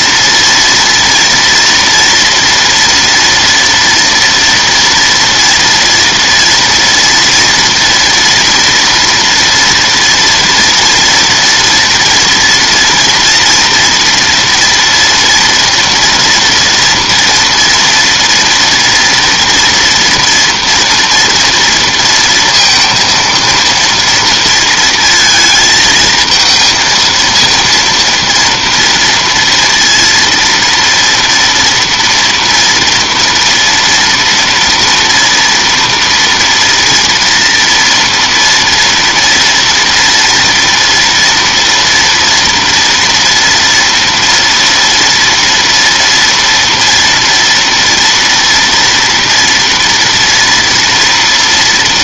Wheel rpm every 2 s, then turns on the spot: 230, 240, 230, 240, 230, 230, 230, 230, 230, 230, 230, 230, 230, 220, 230, 230, 230, 230, 230, 230, 230, 230, 230, 230, 240, 240.
none